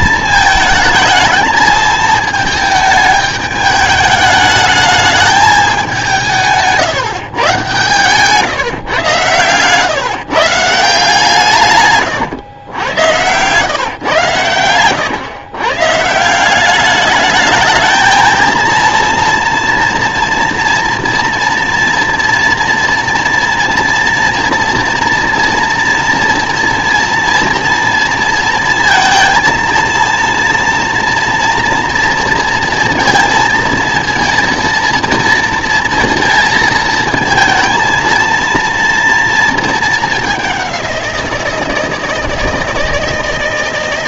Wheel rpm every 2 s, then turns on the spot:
220, 220, 210, 160, 130, 160, 110, 120, 190, 230, 230, 230, 230, 230, 220, 230, 230, 230, 230, 230, 190, 160.
none